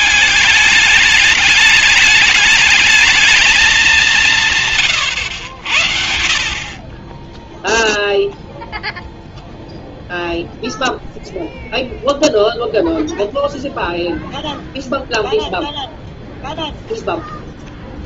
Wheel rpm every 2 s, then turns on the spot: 210, 210, 150, 40, 0, 0, 0, 0, 0.
none